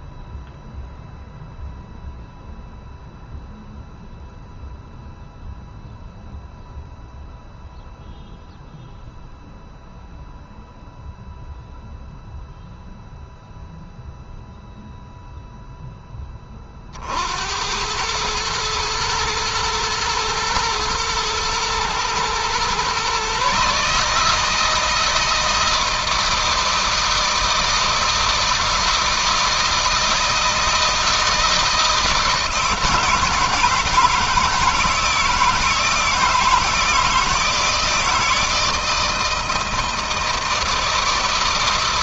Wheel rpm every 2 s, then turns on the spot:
0, 0, 0, 0, 0, 0, 0, 0, 50, 110, 120, 130, 160, 160, 160, 160, 160, 160, 160, 160, 160.
none